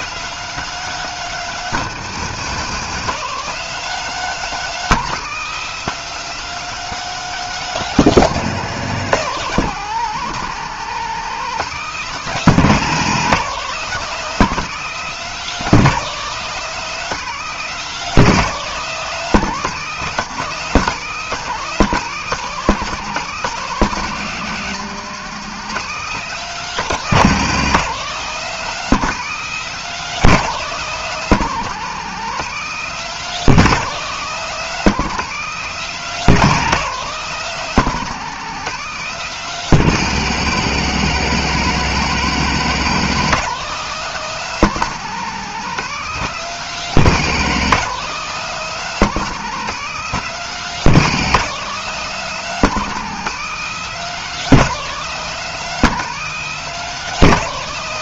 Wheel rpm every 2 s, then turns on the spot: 210, 180, 210, 210, 200, 170, 190, 200, 200, 200, 180, 190, 180, 190, 190, 190, 190, 190, 190, 190, 160, 170, 190, 180, 190, 190, 200, 200, 200.
none